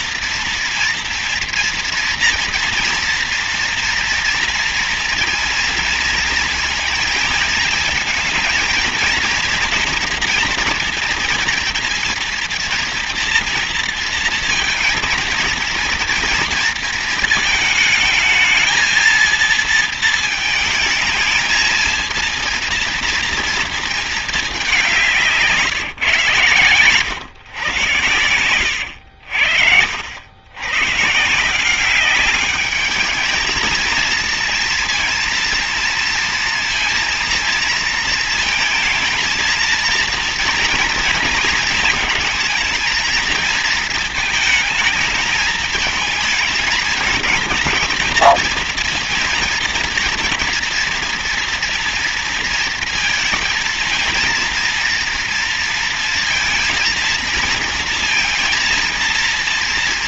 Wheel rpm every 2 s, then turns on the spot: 230, 230, 230, 230, 220, 230, 230, 230, 230, 220, 220, 230, 200, 130, 100, 90, 200, 230, 230, 230, 230, 220, 220, 220, 230, 240, 230, 230, 230, 230.
none